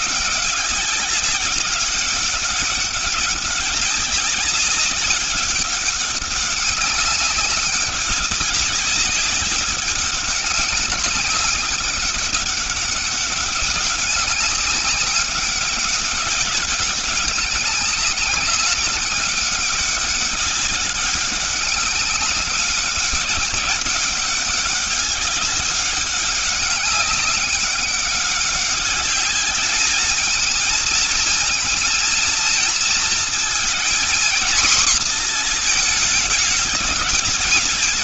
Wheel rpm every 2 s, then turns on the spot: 190, 200, 190, 190, 190, 200, 200, 190, 200, 190, 200, 200, 200, 200, 200, 220, 230, 230, 220.
none